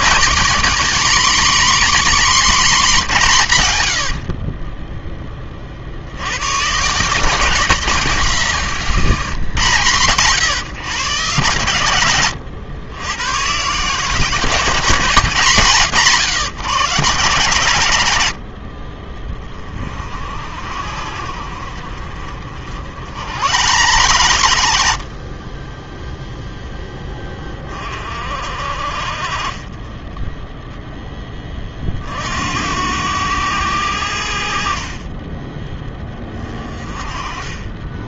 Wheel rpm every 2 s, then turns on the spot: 270, 240, 20, 130, 170, 120, 100, 190, 130, 50, 60, 70, 80, 10, 50, 10, 80, 40, 30.
none